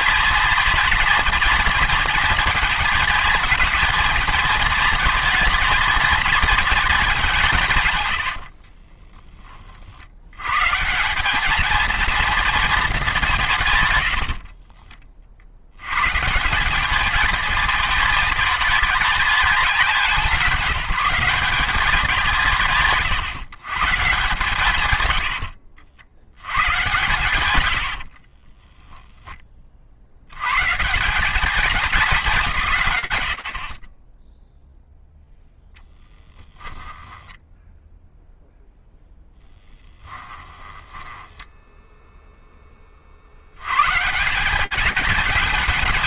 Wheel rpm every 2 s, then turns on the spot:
230, 230, 230, 230, 80, 120, 230, 40, 170, 220, 190, 160, 130, 100, 20, 150, 140, 0, 10, 0, 10, 30, 210.
8-10 14-16 28-30 36-38 40-42